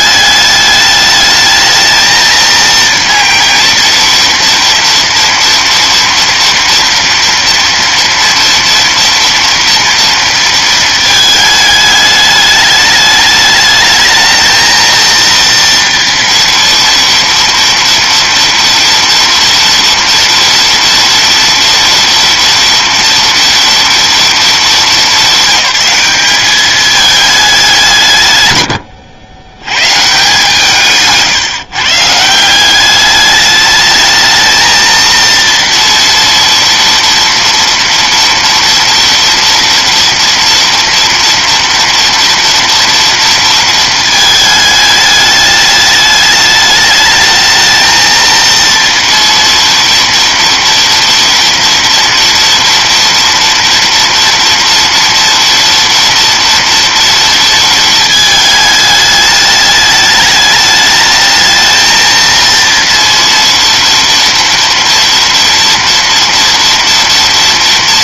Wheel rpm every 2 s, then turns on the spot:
210, 230, 230, 230, 230, 230, 210, 230, 230, 230, 230, 230, 210, 200, 110, 160, 190, 230, 230, 230, 230, 230, 210, 210, 230, 230, 230, 230, 230, 220, 210, 230, 230, 230.
none